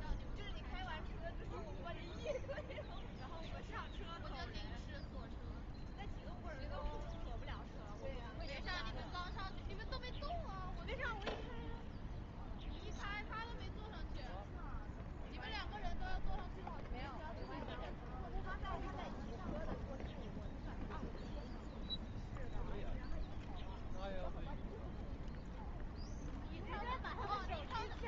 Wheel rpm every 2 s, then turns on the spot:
0, 0, 0, 0, 0, 0, 0, 0, 0, 0, 0, 0, 0, 0.
none